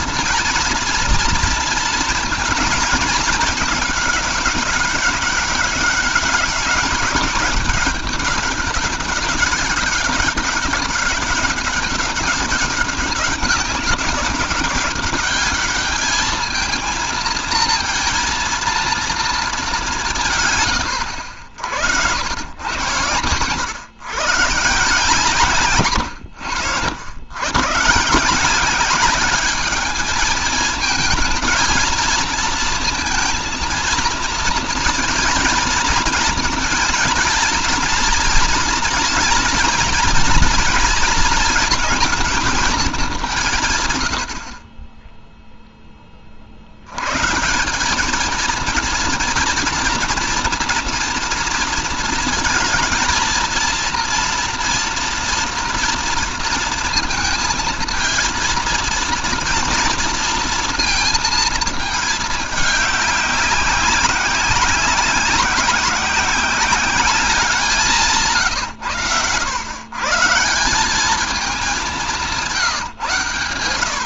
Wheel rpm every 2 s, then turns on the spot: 230, 230, 200, 200, 200, 200, 200, 200, 220, 230, 120, 100, 150, 110, 180, 220, 230, 230, 230, 230, 220, 220, 40, 70, 230, 240, 230, 230, 230, 230, 230, 210, 190, 200, 120, 170, 160.
none